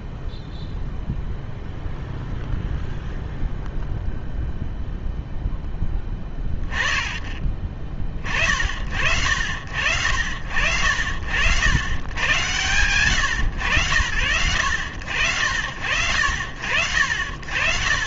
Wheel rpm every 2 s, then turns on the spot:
0, 0, 0, 10, 40, 60, 100, 80, 70.
none